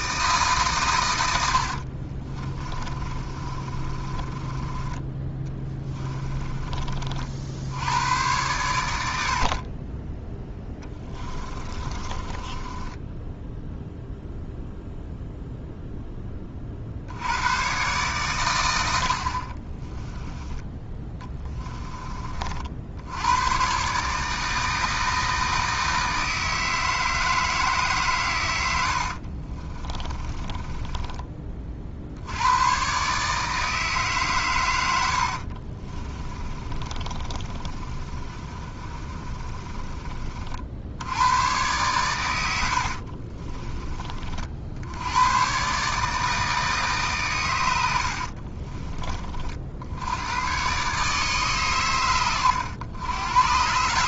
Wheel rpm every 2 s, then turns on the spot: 130, 30, 20, 30, 100, 10, 20, 0, 50, 80, 10, 60, 160, 160, 90, 20, 110, 90, 30, 30, 70, 60, 80, 150, 30, 130, 100.
2-6 10-14 28-32 36-40 42-44 48-50